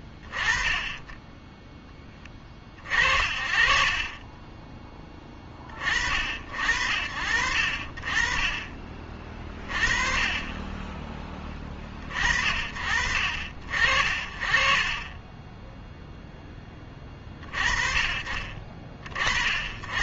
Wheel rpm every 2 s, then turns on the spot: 20, 20, 40, 50, 20, 40, 50, 40, 0, 40.
none